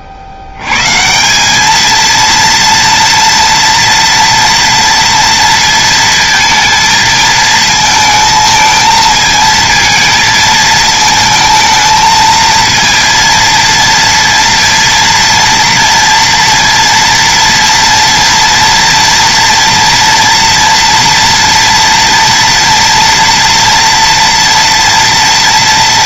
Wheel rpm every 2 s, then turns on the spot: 60, 230, 230, 220, 220, 230, 230, 230, 230, 230, 240, 230, 240.
none